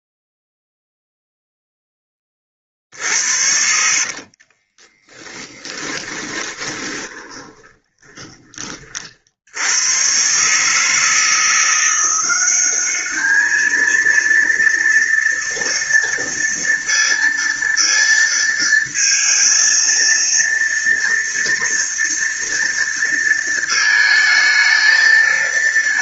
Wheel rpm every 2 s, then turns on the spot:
0, 50, 20, 20, 30, 150, 200, 230, 230, 230, 230, 230, 220.
2-8